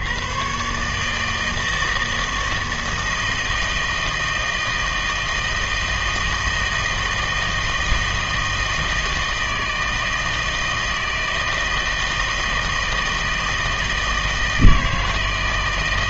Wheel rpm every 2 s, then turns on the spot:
130, 160, 160, 160, 160, 160, 160, 160.
none